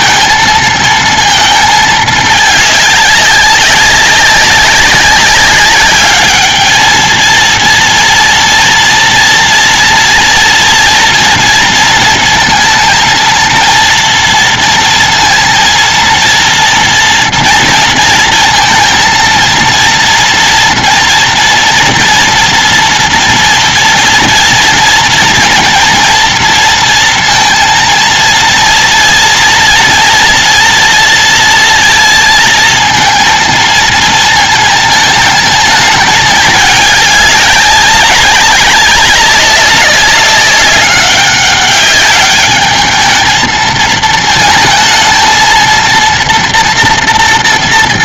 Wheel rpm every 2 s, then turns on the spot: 230, 220, 200, 210, 240, 230, 230, 230, 230, 230, 230, 230, 230, 230, 230, 230, 230, 220, 210, 190, 200, 200, 220, 230.
none